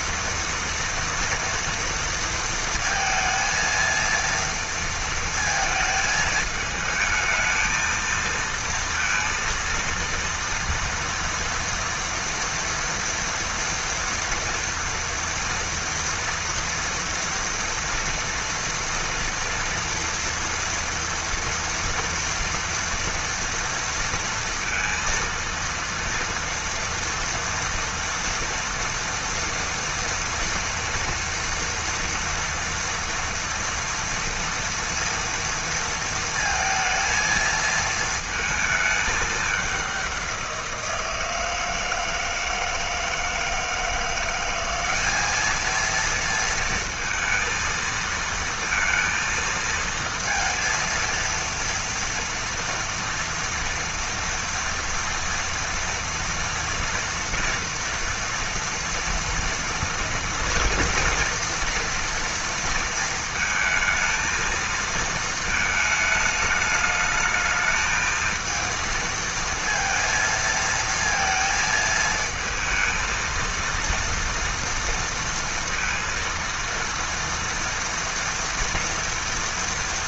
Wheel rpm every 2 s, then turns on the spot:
230, 230, 230, 220, 230, 230, 240, 230, 230, 230, 230, 230, 230, 230, 230, 230, 230, 230, 230, 220, 190, 160, 170, 230, 230, 230, 230, 230, 230, 230, 240, 230, 220, 220, 220, 230, 220, 240, 230, 230.
none